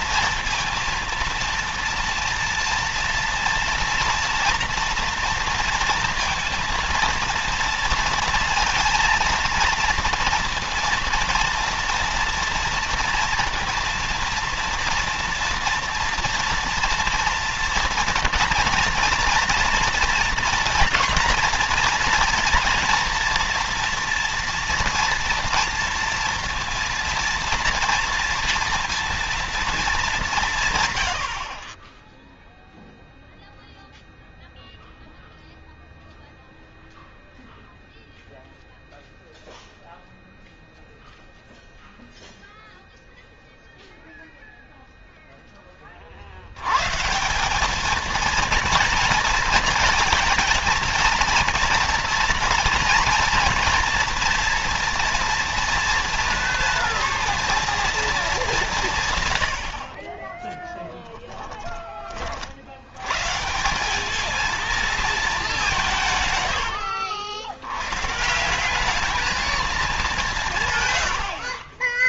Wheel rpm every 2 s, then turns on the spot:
230, 230, 230, 230, 230, 230, 230, 230, 230, 230, 240, 240, 230, 230, 230, 190, 0, 0, 0, 0, 0, 0, 0, 70, 230, 230, 230, 230, 230, 220, 30, 40, 220, 110, 150, 180.
66-68